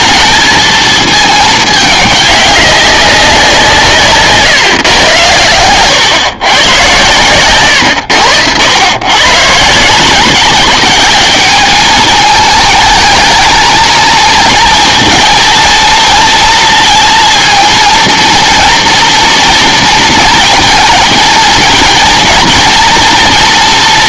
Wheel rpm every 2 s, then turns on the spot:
220, 200, 130, 120, 100, 190, 210, 220, 230, 230, 230, 230.
none